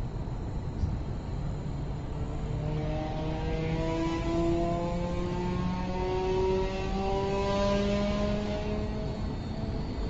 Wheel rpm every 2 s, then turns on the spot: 0, 0, 0, 0, 0.
none